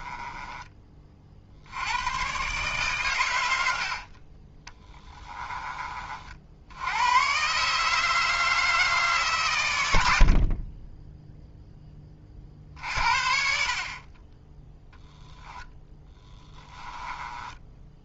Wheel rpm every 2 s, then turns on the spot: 20, 130, 10, 70, 160, 30, 50, 10, 10.
0-2 4-6 16-18